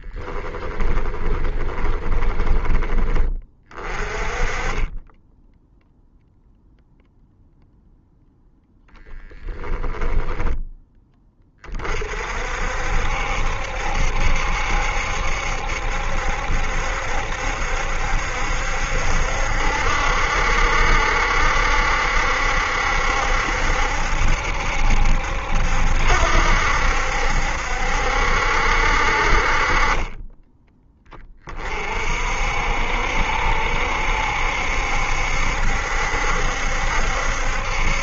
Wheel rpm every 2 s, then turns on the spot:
20, 20, 10, 0, 0, 20, 60, 70, 70, 70, 70, 70, 70, 70, 50, 20, 70, 70, 70.
0-2